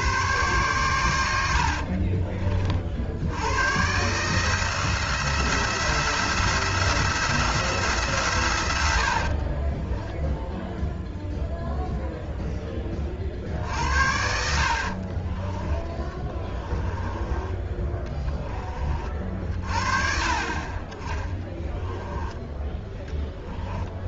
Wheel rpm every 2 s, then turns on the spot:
100, 50, 160, 160, 90, 0, 20, 50, 20, 30, 20, 10.
14-18